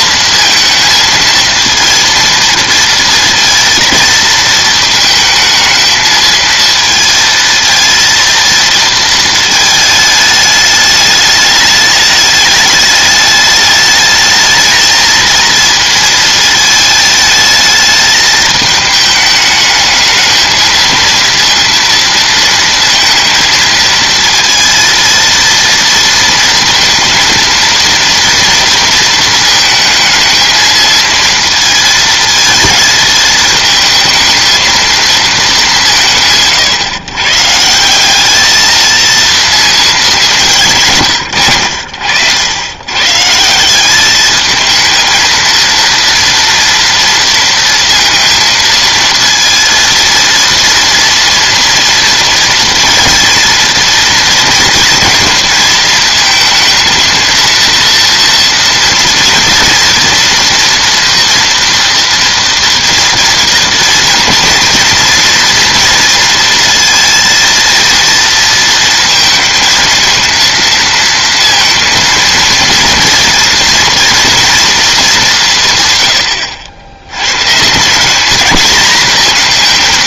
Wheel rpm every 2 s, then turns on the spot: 230, 230, 220, 230, 230, 210, 210, 220, 220, 220, 220, 230, 230, 230, 230, 220, 220, 220, 140, 210, 180, 90, 220, 230, 230, 230, 230, 230, 220, 230, 230, 230, 230, 230, 230, 230, 230, 230, 90, 220.
none